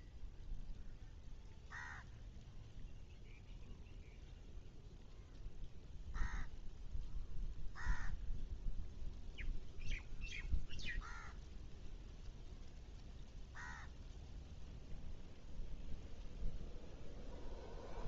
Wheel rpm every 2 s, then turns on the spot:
0, 0, 0, 0, 0, 0, 0, 0, 0.
none